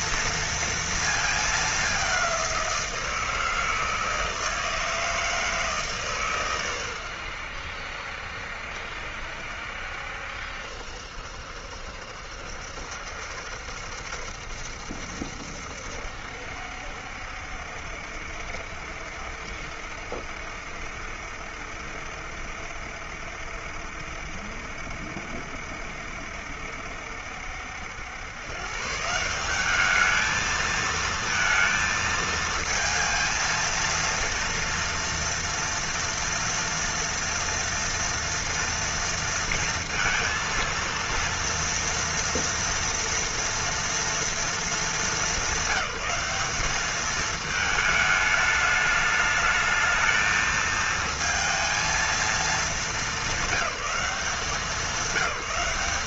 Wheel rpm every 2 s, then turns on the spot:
230, 190, 160, 130, 70, 70, 70, 70, 70, 70, 70, 70, 70, 70, 120, 220, 220, 230, 230, 230, 230, 230, 220, 200, 210, 220, 220, 190.
none